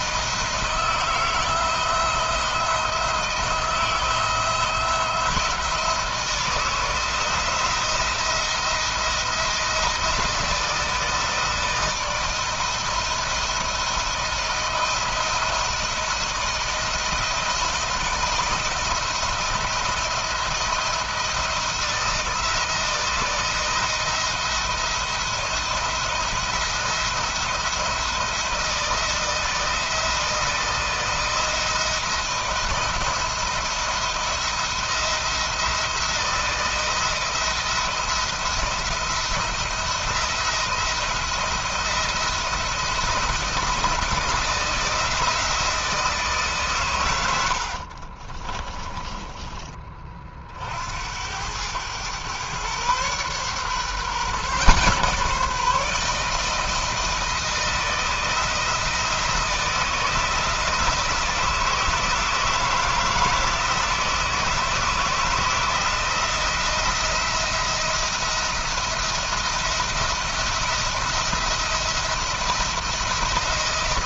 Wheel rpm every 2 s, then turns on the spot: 160, 170, 170, 160, 170, 160, 170, 160, 160, 160, 160, 160, 170, 170, 160, 160, 170, 170, 170, 170, 170, 160, 160, 100, 20, 70, 130, 150, 160, 160, 160, 160, 160, 170, 170, 170, 170.
48-50